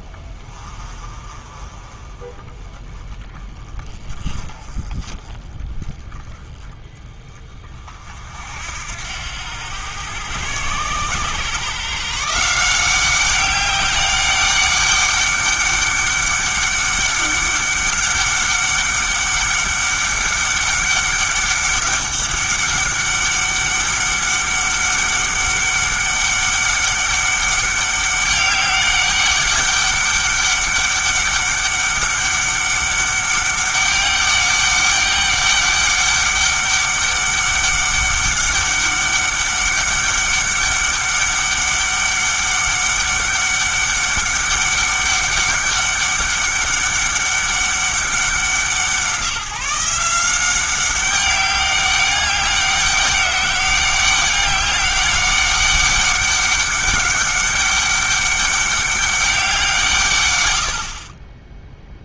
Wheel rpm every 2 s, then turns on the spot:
30, 20, 30, 20, 70, 110, 180, 200, 200, 200, 190, 200, 200, 200, 200, 200, 200, 200, 200, 200, 200, 200, 200, 200, 180, 190, 200, 200, 200, 200, 70.
none